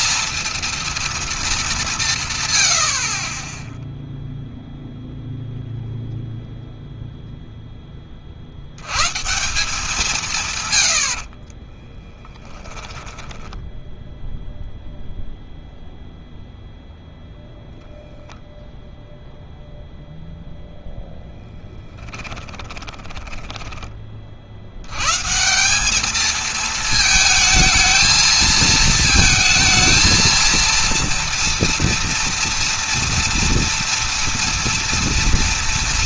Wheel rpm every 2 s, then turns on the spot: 230, 100, 0, 0, 80, 120, 10, 0, 0, 0, 0, 20, 80, 220, 220, 230, 230, 230.
12-14 22-24